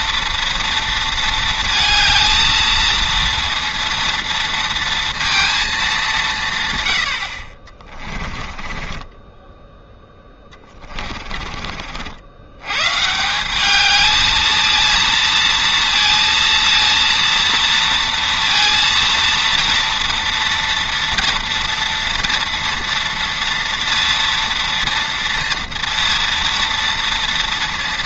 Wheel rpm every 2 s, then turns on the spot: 230, 230, 230, 130, 20, 20, 100, 220, 230, 230, 230, 230, 230, 230.
8-12